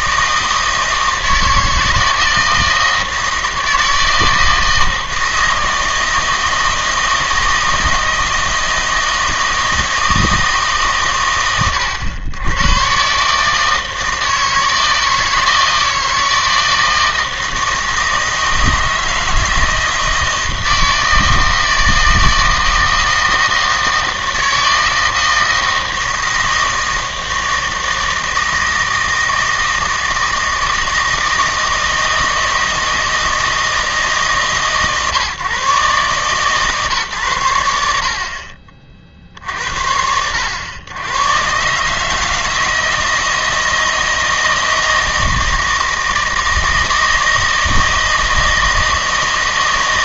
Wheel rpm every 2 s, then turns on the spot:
160, 160, 160, 160, 160, 150, 110, 160, 160, 160, 160, 160, 160, 160, 160, 160, 160, 140, 140, 50, 100, 160, 160, 160, 160.
none